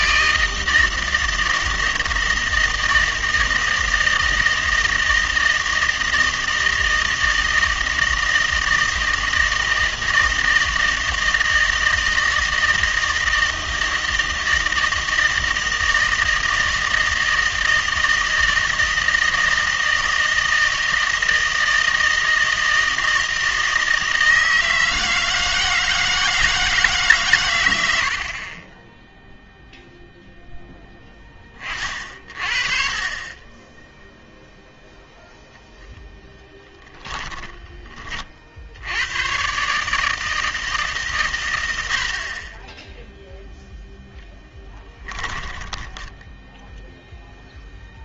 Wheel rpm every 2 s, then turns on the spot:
160, 160, 160, 160, 160, 160, 160, 160, 160, 160, 160, 160, 160, 150, 20, 10, 40, 0, 10, 70, 160, 20, 10, 0.
36-38 44-46